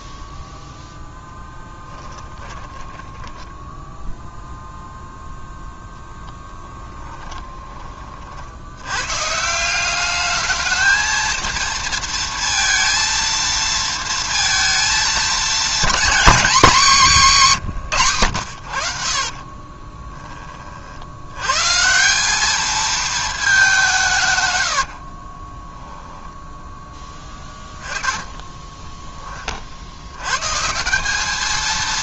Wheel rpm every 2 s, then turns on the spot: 0, 10, 0, 10, 80, 220, 230, 220, 210, 70, 40, 220, 80, 10, 10, 160.
2-4 6-8 24-26